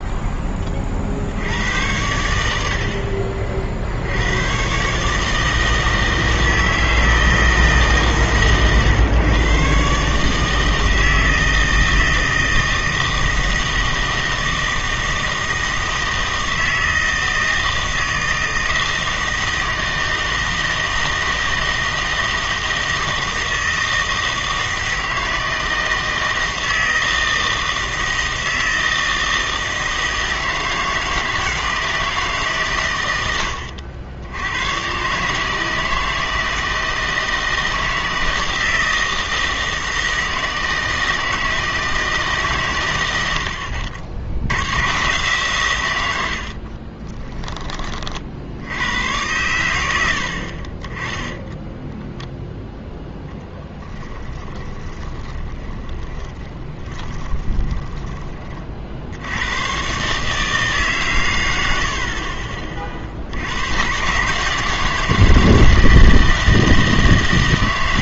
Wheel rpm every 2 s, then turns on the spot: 30, 70, 130, 160, 130, 160, 160, 160, 160, 160, 160, 160, 160, 160, 160, 160, 130, 110, 160, 160, 160, 130, 100, 60, 80, 30, 0, 20, 20, 40, 150, 40, 160, 160.
46-48 54-58